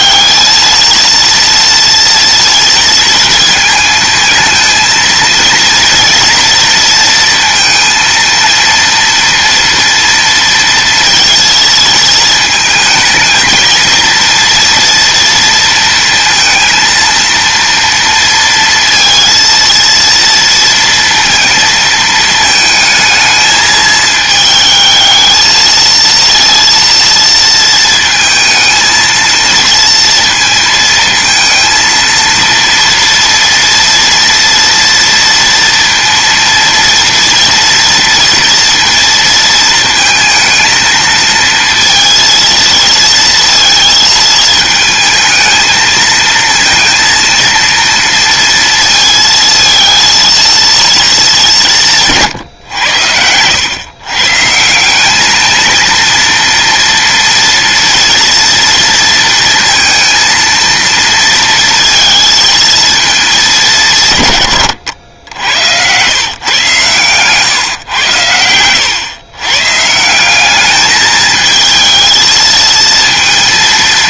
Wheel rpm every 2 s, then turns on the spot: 230, 230, 230, 230, 230, 230, 220, 230, 230, 230, 230, 220, 220, 230, 230, 230, 230, 230, 230, 230, 230, 220, 220, 230, 230, 230, 110, 170, 230, 230, 230, 230, 100, 130, 110, 210, 220.
none